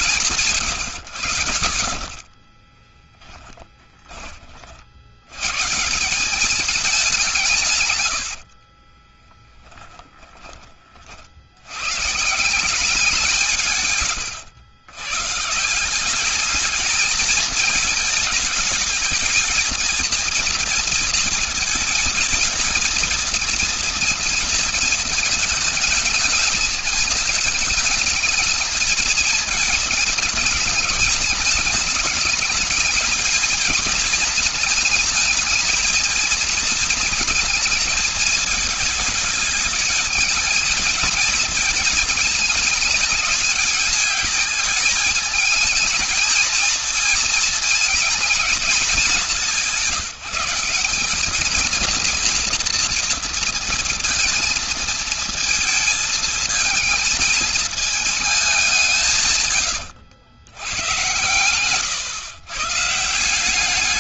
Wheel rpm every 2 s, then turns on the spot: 150, 20, 30, 190, 80, 20, 160, 120, 200, 210, 230, 230, 230, 220, 220, 220, 210, 220, 230, 220, 220, 220, 210, 220, 220, 180, 230, 230, 220, 210, 100, 130.
2-4 8-10